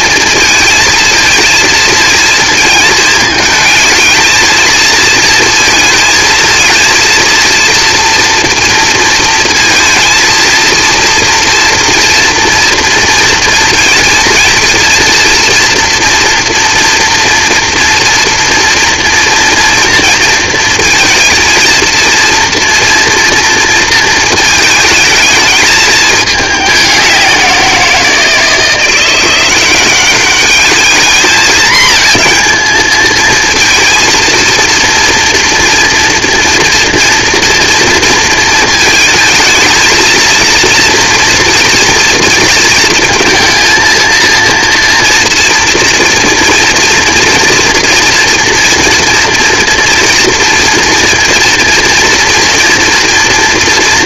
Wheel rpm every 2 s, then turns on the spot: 230, 230, 220, 220, 230, 230, 230, 230, 230, 230, 230, 230, 220, 200, 170, 210, 220, 230, 230, 230, 230, 230, 230, 230, 230, 230, 230.
none